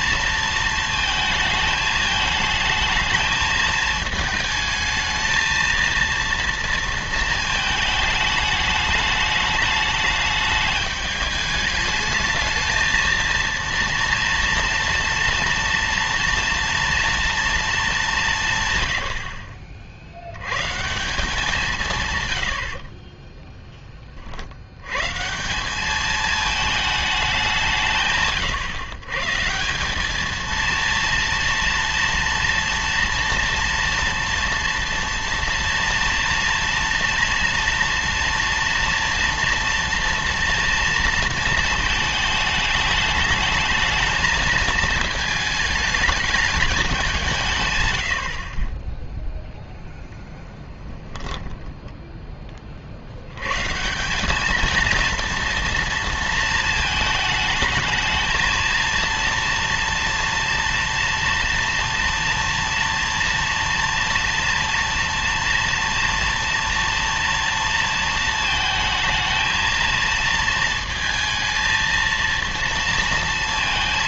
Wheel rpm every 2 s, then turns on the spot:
230, 220, 220, 230, 210, 210, 220, 230, 230, 120, 150, 50, 100, 220, 130, 230, 230, 230, 230, 240, 230, 210, 220, 200, 20, 10, 40, 220, 230, 230, 230, 230, 230, 230, 220, 230, 230.
50-52